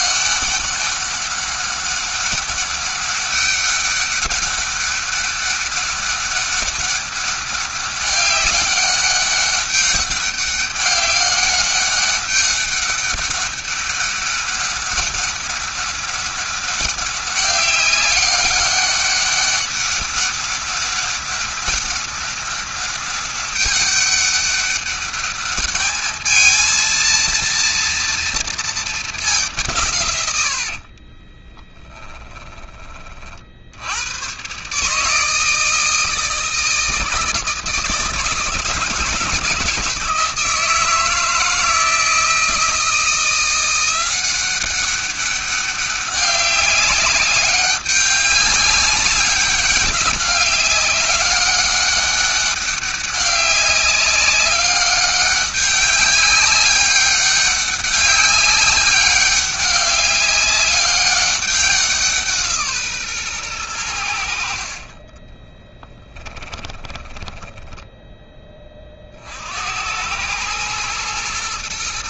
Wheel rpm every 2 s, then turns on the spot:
200, 200, 200, 200, 190, 200, 200, 200, 200, 200, 200, 200, 200, 220, 220, 70, 30, 130, 160, 160, 160, 160, 190, 200, 190, 200, 200, 200, 200, 200, 200, 150, 50, 10, 30, 110.
30-32 64-68